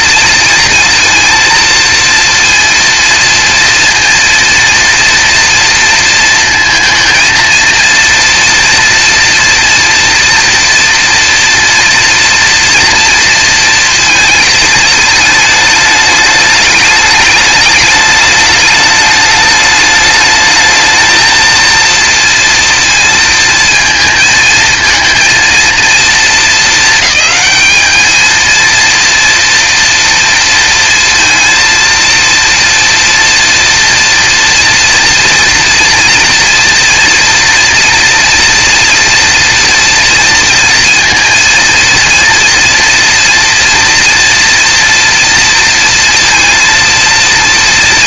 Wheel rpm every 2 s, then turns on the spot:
230, 230, 230, 230, 230, 230, 230, 220, 210, 210, 220, 230, 230, 220, 230, 230, 230, 240, 240, 240, 230, 230, 230, 230.
none